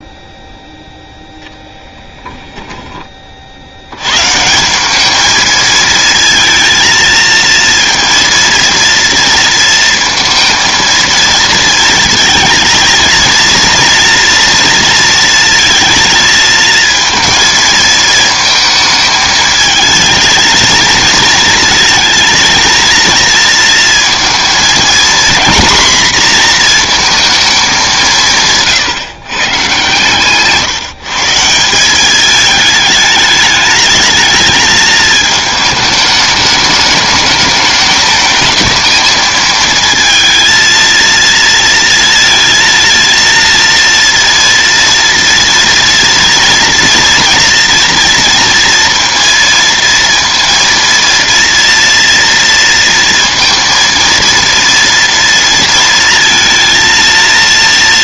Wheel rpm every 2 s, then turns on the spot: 0, 10, 170, 220, 230, 230, 230, 230, 220, 220, 220, 230, 230, 240, 140, 150, 220, 220, 210, 220, 230, 230, 230, 230, 230, 230, 230, 230, 230.
none